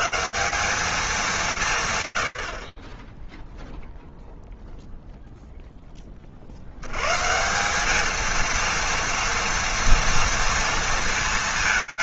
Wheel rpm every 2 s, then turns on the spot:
220, 40, 0, 110, 230, 230.
none